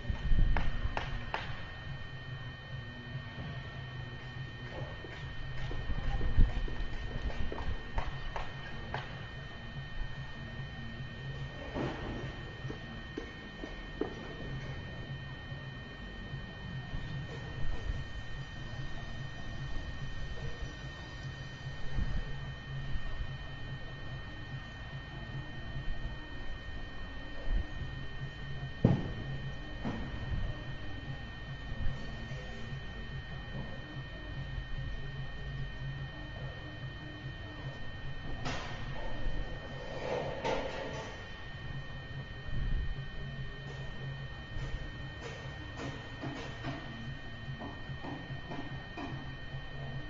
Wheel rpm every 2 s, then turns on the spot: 0, 0, 0, 0, 0, 0, 0, 0, 0, 0, 0, 0, 0, 0, 0, 0, 0, 0, 0, 0, 0, 0, 0, 0, 0.
none